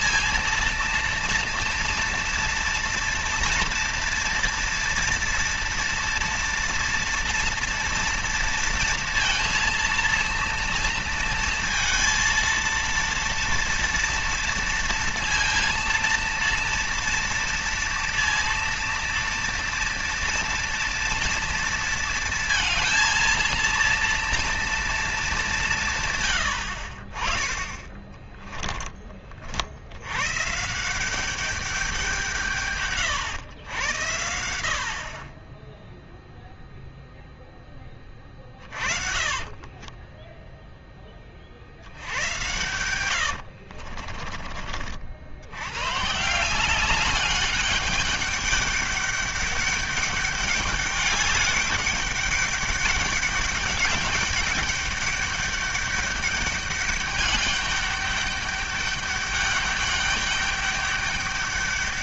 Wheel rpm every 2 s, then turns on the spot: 230, 230, 230, 240, 230, 230, 230, 230, 230, 230, 230, 230, 230, 80, 10, 160, 130, 60, 0, 30, 10, 100, 50, 180, 200, 200, 200, 200, 200, 200, 200.
38-40 42-44